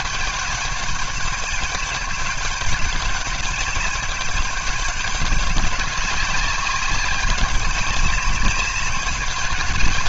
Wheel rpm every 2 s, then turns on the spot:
200, 200, 200, 190, 200.
none